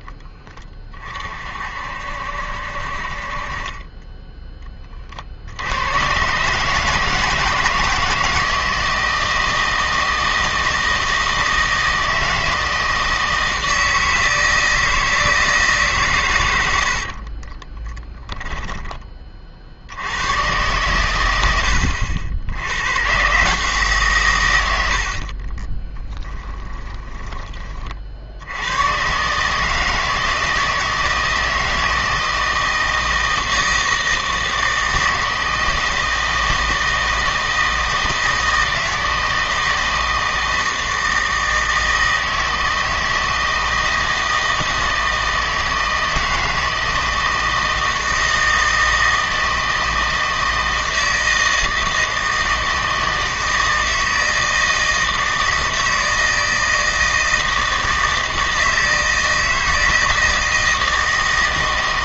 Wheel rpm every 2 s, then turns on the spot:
30, 60, 20, 150, 160, 160, 160, 160, 80, 20, 120, 100, 90, 20, 100, 160, 160, 160, 160, 160, 160, 160, 160, 160, 160, 160, 160, 160, 160, 160, 160.
16-20 26-28